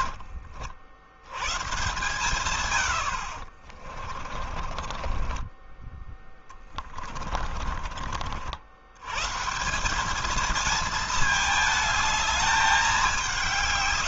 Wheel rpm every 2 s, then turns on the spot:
80, 80, 30, 20, 110, 220, 190.
4-8